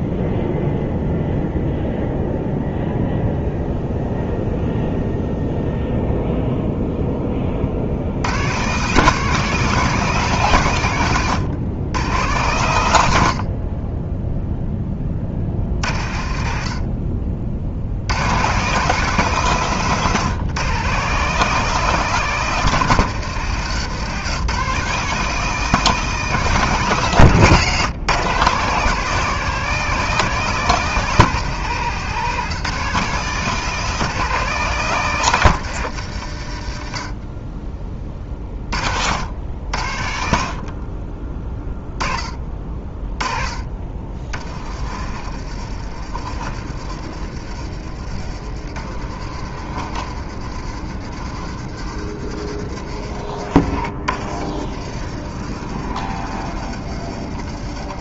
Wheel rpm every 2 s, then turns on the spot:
0, 0, 0, 0, 130, 160, 120, 0, 50, 140, 140, 170, 160, 170, 150, 180, 170, 170, 80, 40, 50, 20, 40, 50, 50, 60, 60, 50, 50.
none